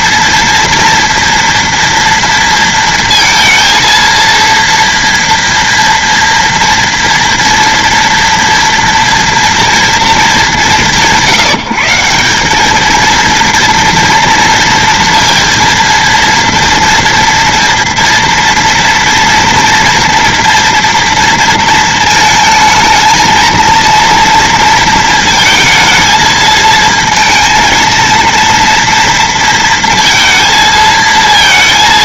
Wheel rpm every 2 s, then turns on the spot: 230, 230, 230, 230, 230, 190, 210, 230, 230, 230, 230, 220, 230, 220, 230, 230.
none